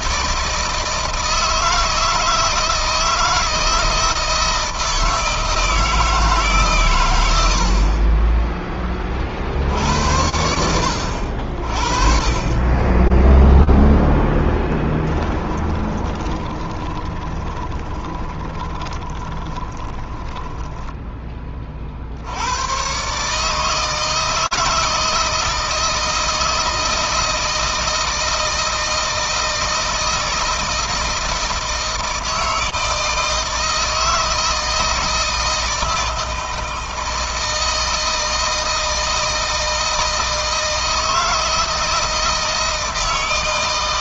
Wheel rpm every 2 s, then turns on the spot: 160, 160, 160, 120, 20, 80, 20, 10, 20, 10, 10, 120, 160, 160, 160, 160, 160, 160, 160, 160, 160, 150.
14-22